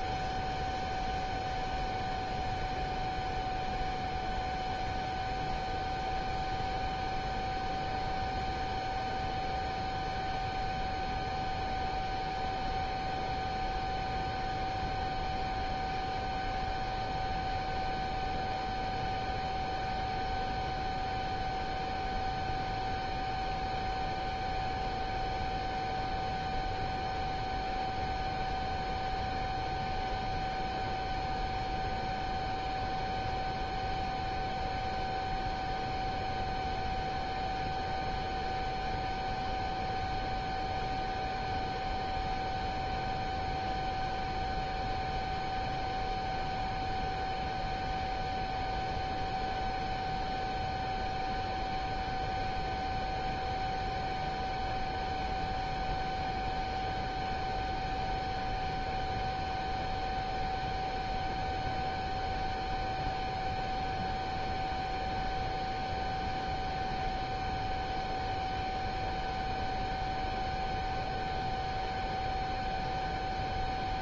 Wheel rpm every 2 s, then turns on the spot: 0, 0, 0, 0, 0, 0, 0, 0, 0, 0, 0, 0, 0, 0, 0, 0, 0, 0, 0, 0, 0, 0, 0, 0, 0, 0, 0, 0, 0, 0, 0, 0, 0, 0, 0, 0, 0.
none